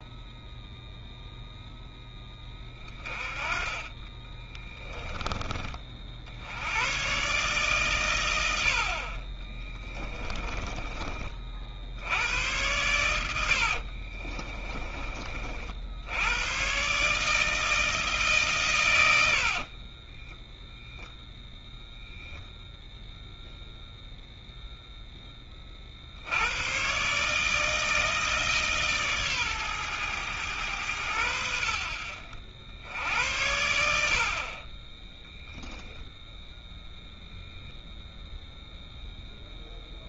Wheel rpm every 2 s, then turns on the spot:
0, 20, 20, 80, 80, 30, 110, 30, 120, 130, 10, 0, 0, 100, 150, 110, 70, 30, 0, 0.
4-6 10-12 14-16 20-22